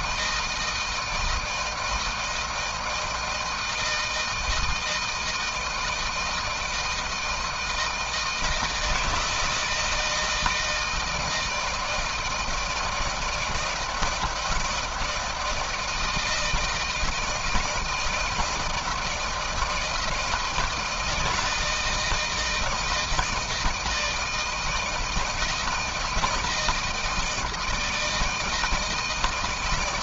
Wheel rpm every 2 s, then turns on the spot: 160, 160, 160, 160, 160, 160, 160, 160, 160, 160, 160, 160, 160, 170, 160.
none